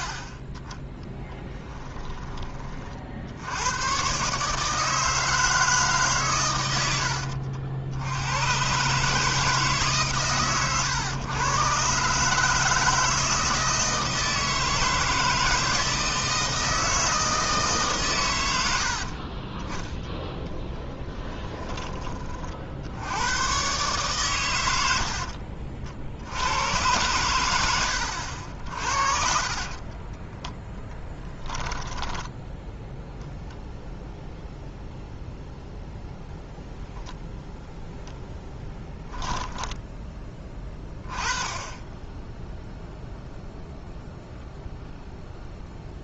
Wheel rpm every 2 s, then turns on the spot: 30, 30, 150, 90, 130, 120, 160, 160, 160, 80, 10, 60, 90, 100, 60, 10, 0, 0, 0, 0, 10, 0, 0.
20-22 28-32